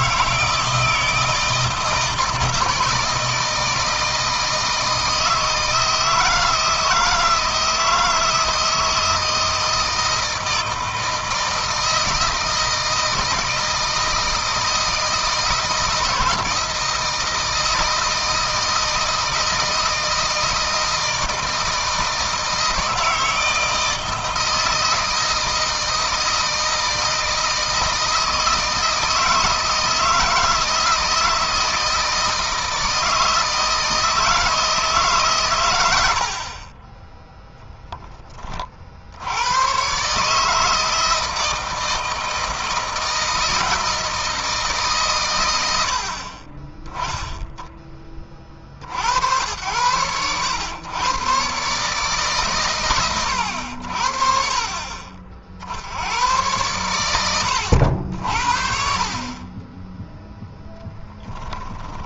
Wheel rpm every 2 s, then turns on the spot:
160, 160, 160, 160, 160, 160, 160, 160, 160, 160, 160, 160, 160, 160, 160, 160, 160, 160, 30, 40, 160, 160, 160, 20, 60, 100, 120, 30, 100, 60, 10.
none